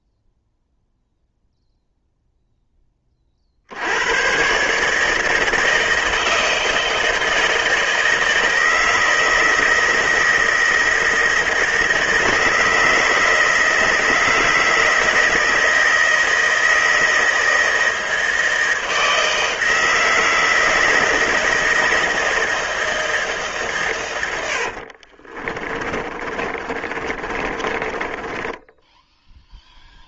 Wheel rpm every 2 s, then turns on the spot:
0, 30, 150, 160, 160, 160, 160, 170, 160, 160, 160, 160, 40, 30, 0.
24-28